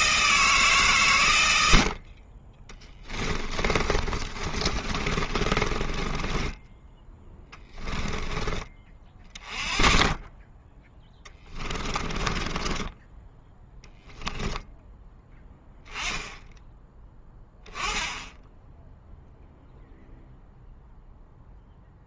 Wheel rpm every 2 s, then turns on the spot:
140, 20, 30, 10, 20, 10, 10, 10, 10, 0, 0.
2-8 12-14